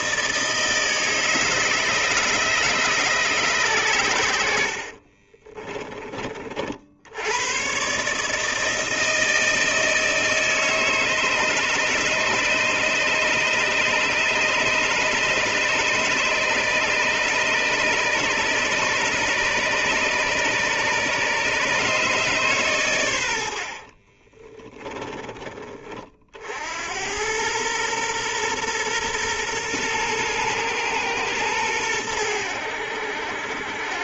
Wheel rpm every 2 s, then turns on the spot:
160, 150, 60, 50, 160, 160, 150, 150, 150, 140, 140, 110, 10, 80, 120, 120, 80.
4-6